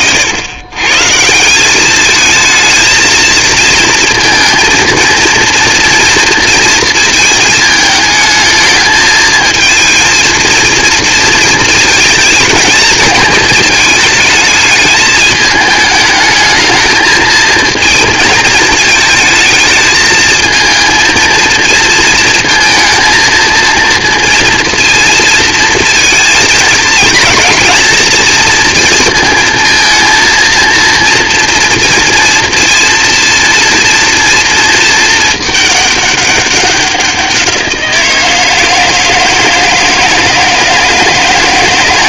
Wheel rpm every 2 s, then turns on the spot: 100, 220, 230, 230, 220, 220, 220, 220, 220, 220, 220, 230, 230, 230, 240, 230, 230, 230, 200, 170, 160.
none